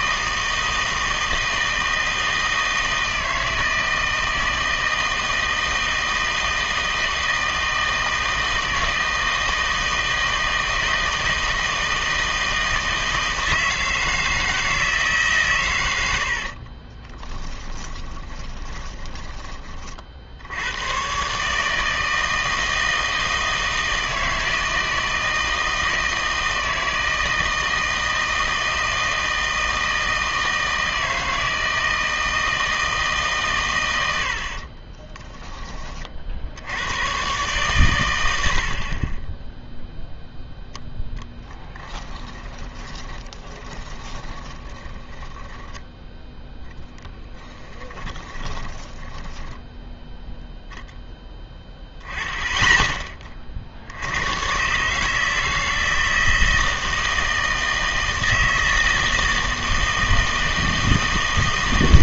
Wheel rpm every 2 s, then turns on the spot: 160, 160, 160, 160, 160, 160, 160, 160, 40, 20, 100, 160, 160, 160, 160, 160, 160, 50, 90, 60, 0, 10, 20, 0, 20, 0, 10, 140, 160, 160, 160.
16-20 34-36 38-40 42-46 48-50